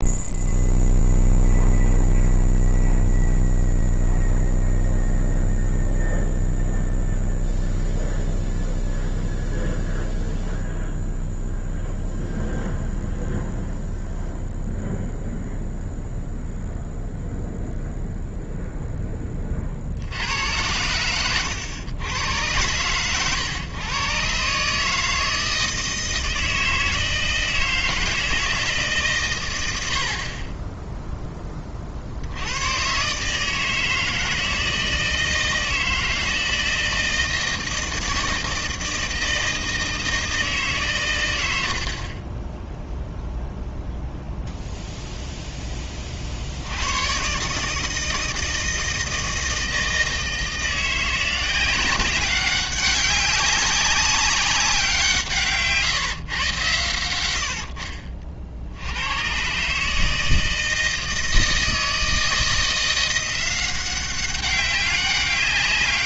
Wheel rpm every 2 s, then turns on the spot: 0, 0, 0, 0, 0, 0, 0, 0, 0, 0, 100, 120, 140, 160, 150, 10, 120, 160, 160, 160, 140, 10, 0, 80, 160, 170, 190, 180, 100, 60, 160, 170, 200.
none